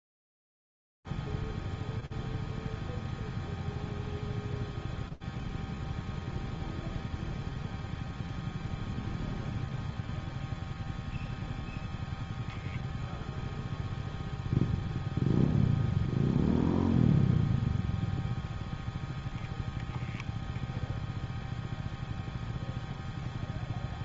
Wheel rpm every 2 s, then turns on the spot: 0, 0, 0, 0, 0, 0, 0, 0, 0, 0, 0, 0.
none